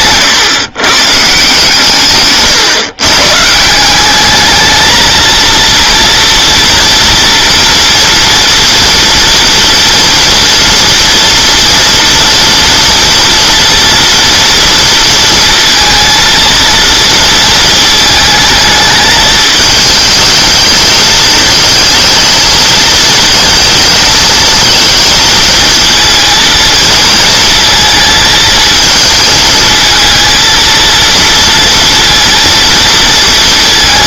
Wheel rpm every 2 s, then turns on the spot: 130, 120, 220, 230, 230, 230, 240, 230, 230, 220, 220, 220, 230, 230, 220, 230, 230.
none